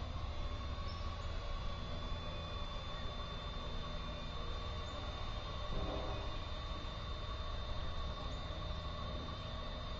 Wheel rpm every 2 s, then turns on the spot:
0, 0, 0, 0, 0.
none